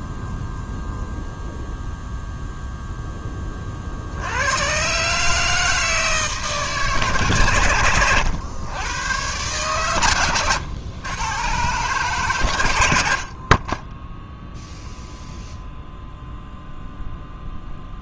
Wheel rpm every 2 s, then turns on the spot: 0, 0, 90, 140, 100, 110, 110, 0, 0.
none